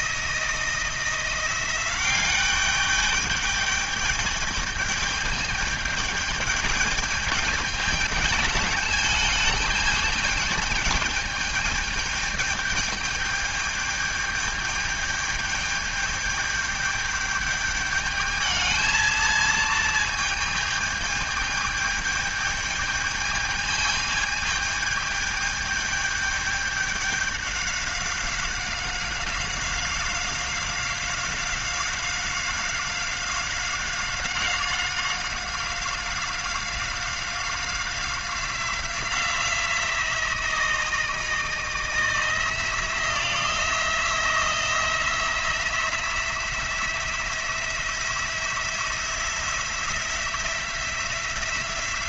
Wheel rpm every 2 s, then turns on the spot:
160, 200, 210, 210, 210, 210, 210, 210, 210, 220, 220, 210, 210, 210, 190, 190, 190, 190, 190, 180, 170, 170, 170, 170, 170, 170.
none